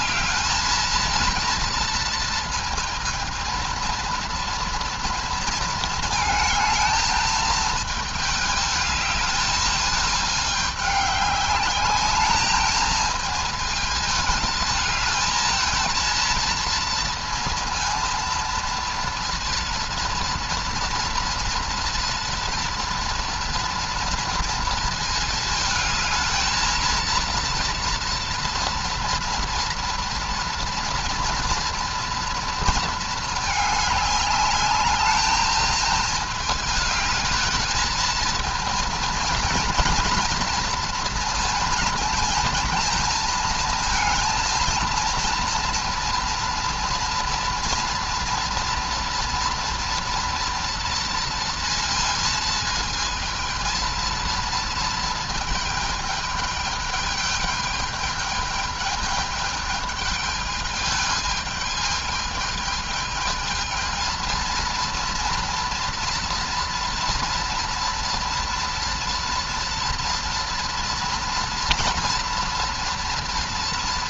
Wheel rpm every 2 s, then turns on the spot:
220, 230, 230, 220, 220, 210, 220, 220, 230, 230, 230, 230, 230, 220, 230, 240, 220, 210, 210, 230, 230, 220, 230, 230, 230, 230, 220, 230, 210, 210, 210, 220, 230, 230, 230, 230, 230.
none